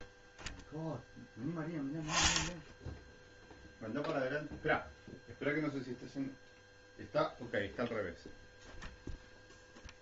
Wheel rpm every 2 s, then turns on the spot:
0, 10, 0, 0, 0.
2-4